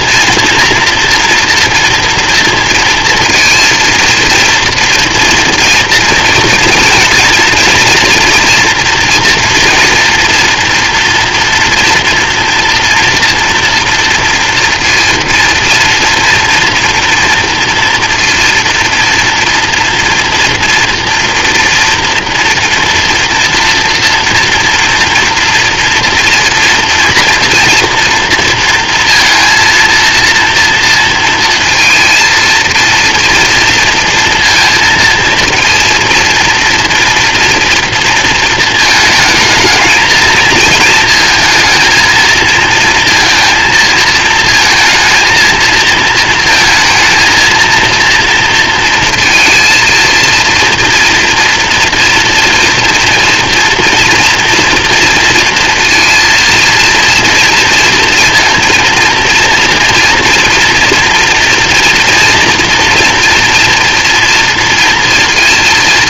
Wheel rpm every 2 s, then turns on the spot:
230, 230, 230, 230, 230, 240, 240, 230, 230, 230, 230, 230, 230, 230, 230, 230, 230, 230, 230, 220, 220, 230, 220, 230, 230, 230, 230, 230, 230, 230, 230, 230, 230.
none